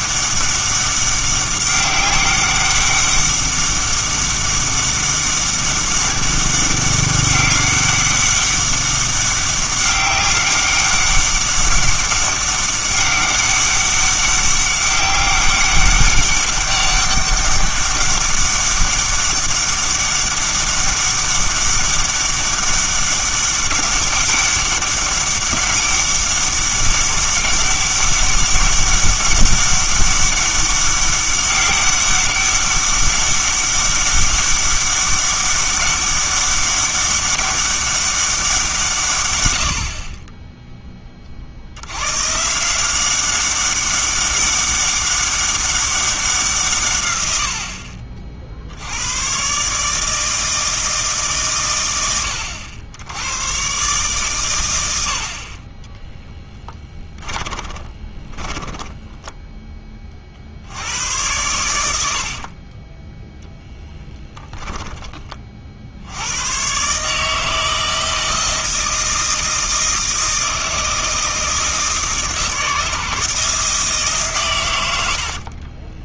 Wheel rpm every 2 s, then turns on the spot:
200, 200, 200, 200, 200, 190, 200, 200, 200, 200, 200, 200, 200, 200, 200, 200, 200, 200, 200, 170, 20, 170, 200, 160, 70, 160, 80, 100, 20, 10, 70, 40, 10, 120, 160, 160, 160, 110.
56-60 62-66